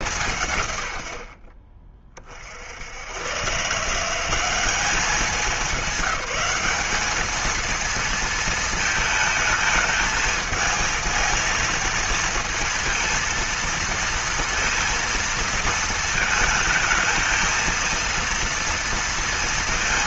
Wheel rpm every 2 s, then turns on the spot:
150, 60, 190, 190, 230, 220, 230, 230, 220, 230.
none